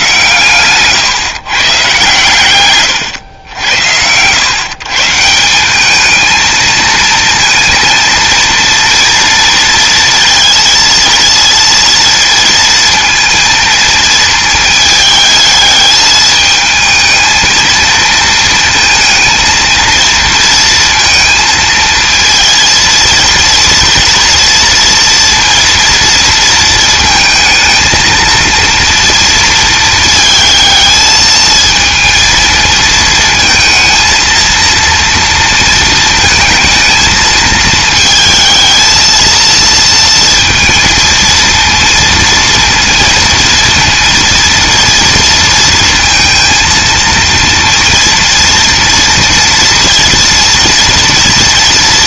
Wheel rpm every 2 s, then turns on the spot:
140, 110, 160, 230, 230, 230, 230, 220, 220, 230, 230, 230, 230, 230, 230, 220, 220, 230, 220, 220, 230, 230, 230, 230, 230, 240.
none